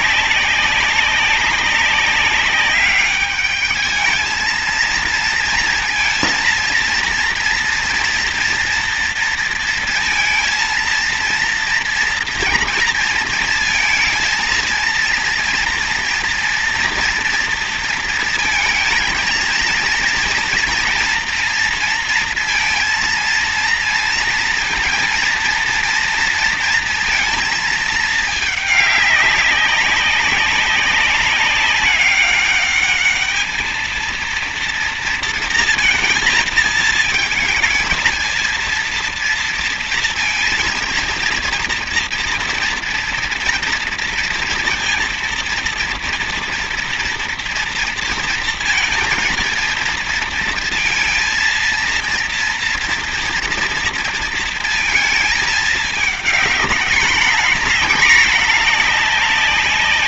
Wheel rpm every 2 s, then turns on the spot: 190, 200, 220, 230, 230, 230, 230, 230, 230, 230, 230, 230, 230, 230, 210, 200, 200, 230, 220, 230, 220, 230, 230, 240, 230, 230, 230, 230, 210, 220.
none